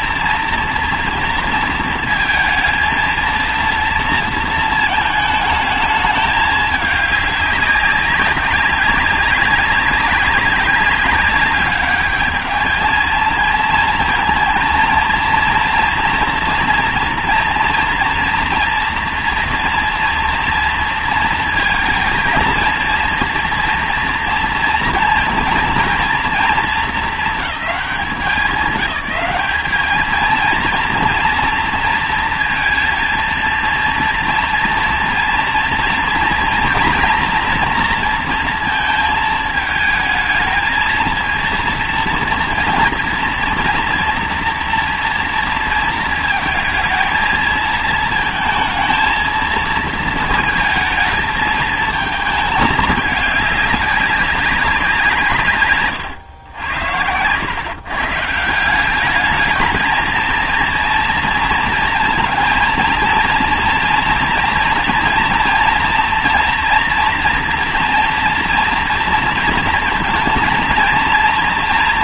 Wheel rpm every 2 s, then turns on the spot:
230, 230, 230, 210, 200, 200, 220, 230, 240, 240, 230, 230, 230, 220, 200, 230, 230, 230, 230, 230, 230, 230, 240, 220, 230, 220, 210, 190, 90, 170, 230, 230, 230, 230, 230, 220.
none